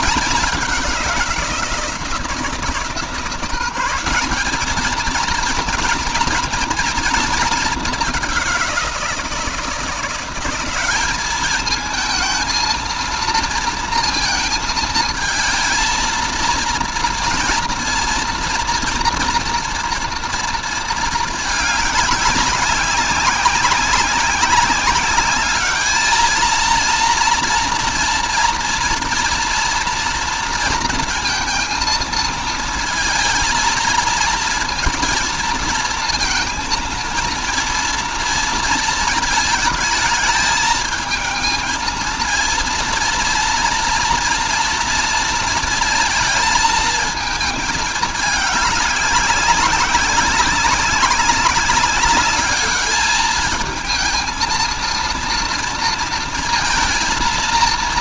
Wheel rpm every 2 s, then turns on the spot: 200, 160, 200, 230, 190, 190, 230, 230, 230, 230, 230, 200, 200, 220, 230, 230, 220, 230, 230, 230, 220, 230, 230, 230, 210, 190, 200, 220, 230.
none